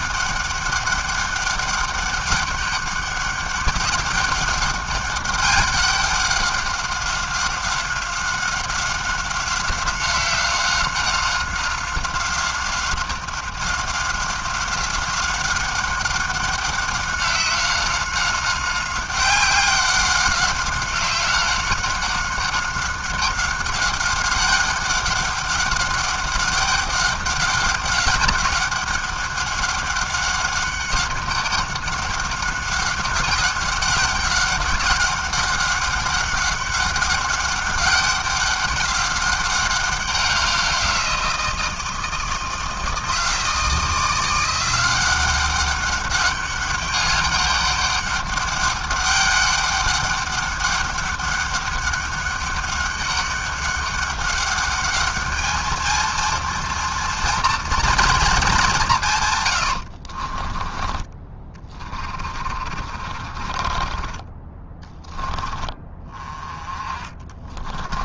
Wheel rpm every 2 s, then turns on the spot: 200, 190, 200, 190, 190, 190, 190, 190, 190, 190, 190, 190, 200, 200, 190, 200, 200, 190, 190, 190, 190, 160, 170, 200, 200, 200, 200, 200, 230, 210, 40, 40, 20, 20.
60-64